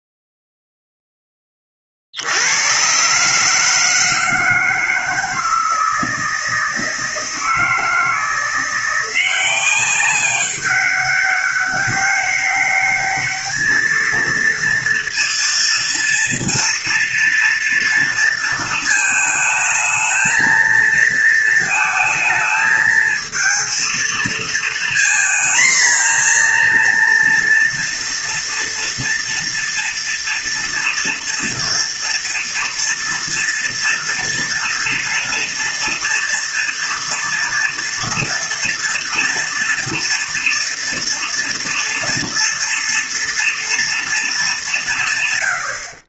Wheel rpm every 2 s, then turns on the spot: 0, 110, 160, 160, 170, 200, 200, 230, 230, 230, 230, 220, 230, 240, 230, 230, 230, 230, 230, 230, 230, 240, 180.
none